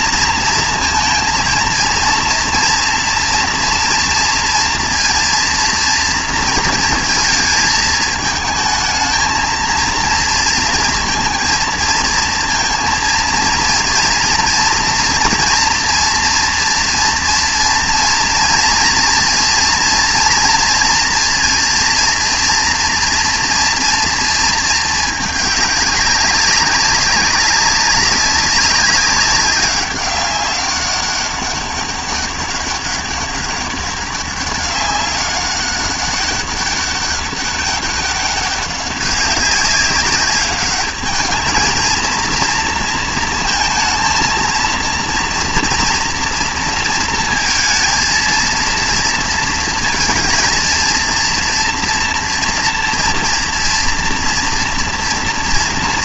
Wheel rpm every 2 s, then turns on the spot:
230, 230, 230, 230, 220, 230, 230, 230, 230, 230, 230, 230, 220, 200, 200, 190, 200, 200, 200, 200, 200, 230, 230, 230, 230, 230, 230, 230.
none